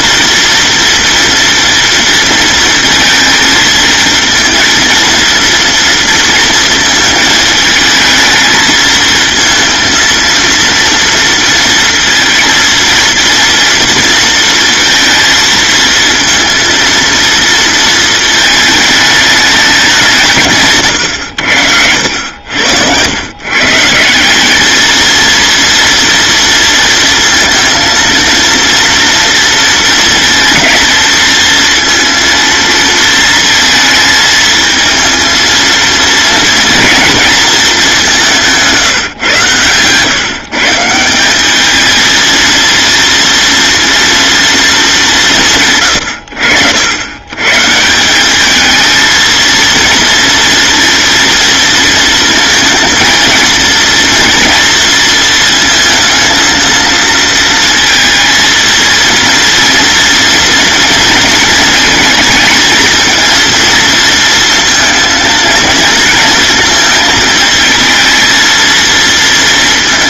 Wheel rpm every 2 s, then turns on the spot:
230, 230, 230, 220, 220, 230, 230, 230, 230, 210, 90, 130, 230, 230, 230, 230, 230, 230, 220, 120, 200, 230, 150, 130, 230, 230, 230, 230, 230, 230, 230, 230, 230, 220, 230.
20-22